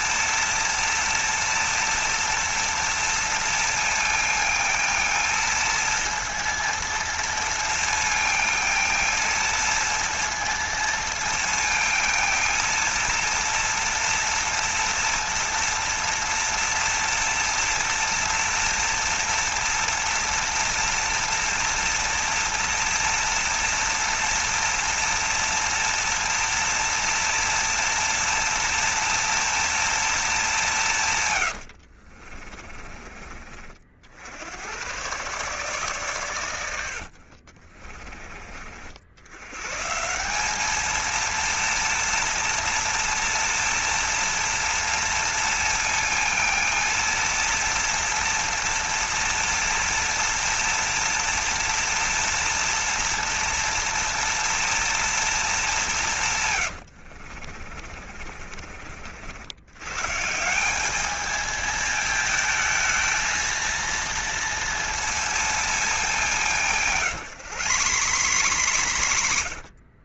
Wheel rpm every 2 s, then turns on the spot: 230, 230, 230, 230, 230, 230, 230, 230, 230, 230, 230, 230, 230, 230, 230, 200, 40, 100, 100, 50, 200, 230, 230, 230, 230, 230, 230, 230, 120, 50, 180, 220, 230, 180, 110.
32-34 56-60 66-70